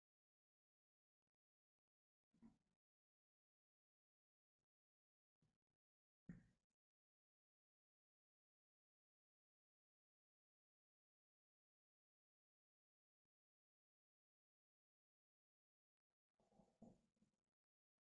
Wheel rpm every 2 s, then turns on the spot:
0, 0, 0, 0, 0, 0, 0, 0, 0.
none